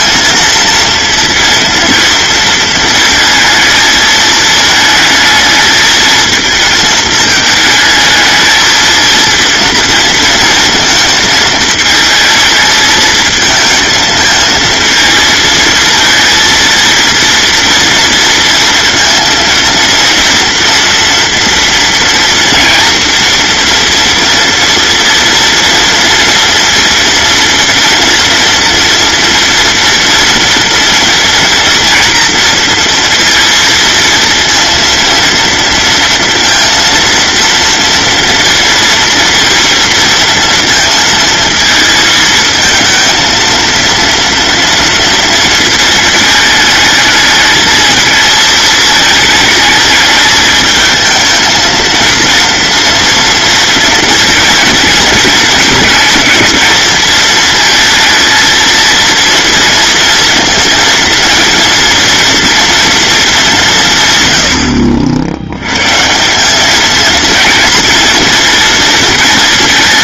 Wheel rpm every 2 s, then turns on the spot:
230, 230, 220, 220, 220, 230, 220, 230, 230, 230, 230, 230, 230, 230, 240, 230, 230, 230, 230, 230, 230, 230, 230, 220, 220, 220, 230, 220, 220, 230, 230, 230, 70, 210, 230.
none